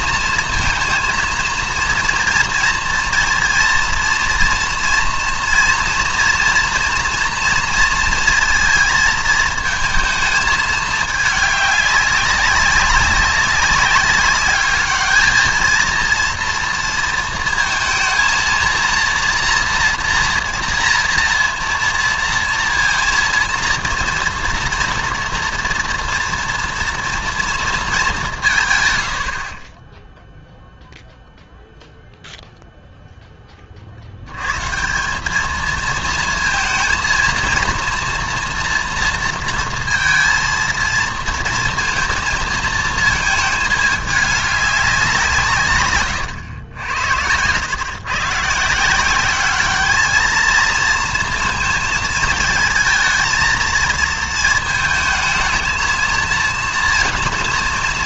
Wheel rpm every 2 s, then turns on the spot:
230, 230, 230, 230, 230, 220, 200, 210, 230, 230, 230, 230, 230, 230, 120, 0, 0, 130, 230, 240, 230, 230, 210, 90, 150, 220, 220, 230, 230.
none